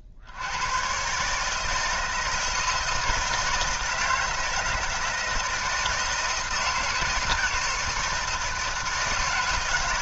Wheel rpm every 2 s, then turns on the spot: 100, 160, 160, 160, 160.
none